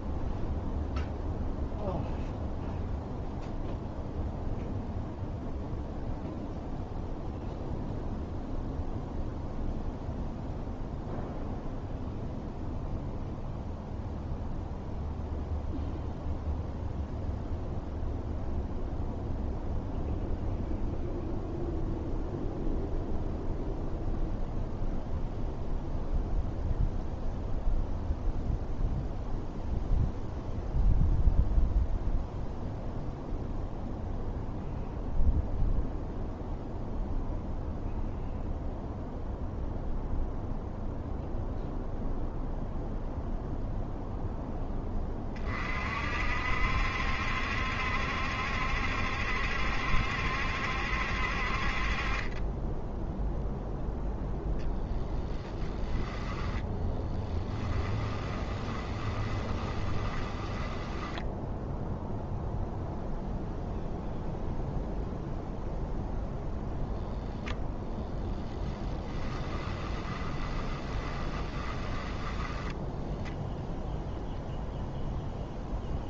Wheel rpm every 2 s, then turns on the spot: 0, 0, 0, 0, 0, 0, 0, 0, 0, 0, 0, 0, 0, 0, 0, 0, 0, 0, 0, 0, 0, 0, 20, 70, 70, 60, 0, 0, 10, 20, 10, 0, 0, 0, 20, 20, 10, 0.
56-62 68-74